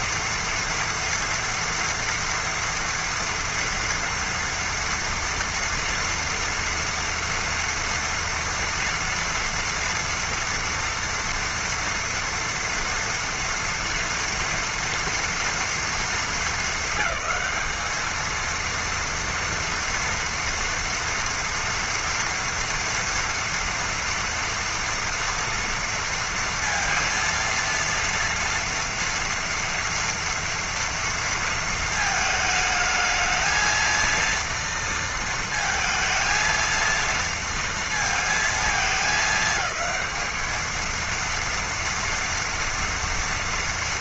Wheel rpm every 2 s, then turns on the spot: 230, 230, 230, 230, 230, 230, 230, 230, 200, 230, 240, 230, 230, 230, 230, 230, 220, 230, 230, 230, 220, 230.
none